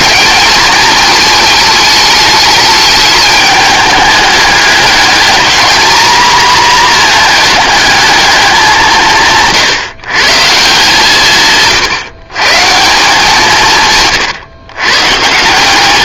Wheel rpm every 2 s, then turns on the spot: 220, 210, 210, 240, 180, 160, 160, 130.
none